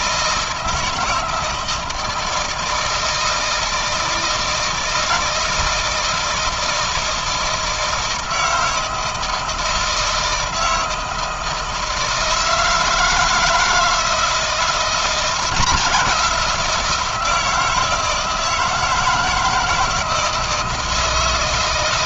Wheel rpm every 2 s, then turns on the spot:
160, 160, 160, 160, 160, 160, 160, 170, 170, 160, 160.
none